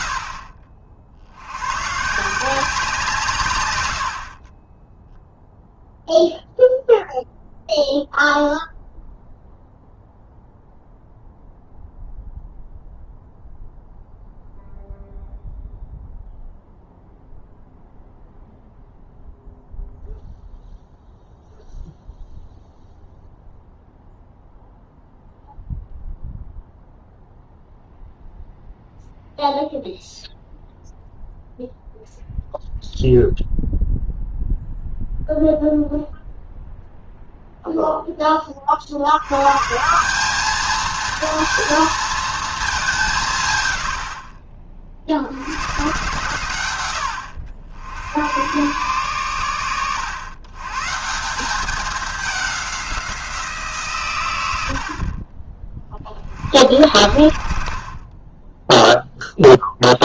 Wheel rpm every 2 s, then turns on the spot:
60, 170, 10, 0, 0, 0, 0, 0, 0, 0, 0, 0, 0, 0, 0, 0, 0, 0, 0, 60, 220, 200, 50, 110, 130, 150, 180, 70, 60, 10.
none